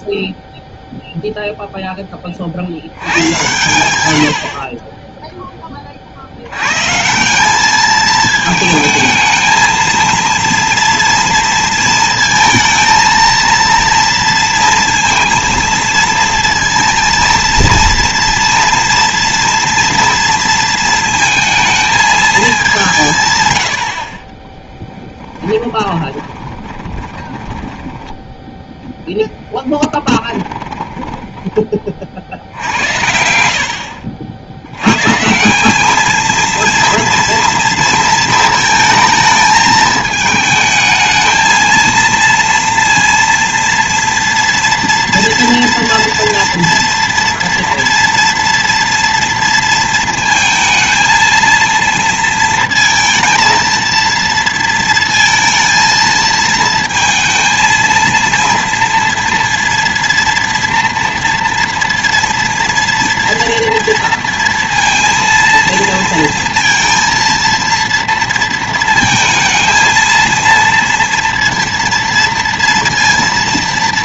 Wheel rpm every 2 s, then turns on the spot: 0, 60, 40, 110, 220, 230, 220, 230, 230, 230, 230, 210, 20, 20, 10, 20, 70, 70, 230, 220, 220, 230, 230, 230, 230, 230, 230, 230, 220, 230, 230, 230, 230, 230, 230, 230, 230.
24-28 30-32